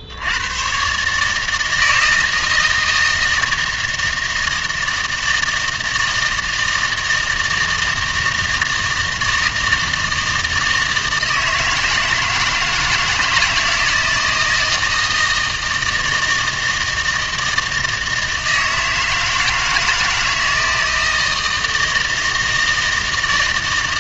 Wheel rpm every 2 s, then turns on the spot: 110, 160, 160, 160, 160, 160, 160, 160, 160, 160, 160, 160.
none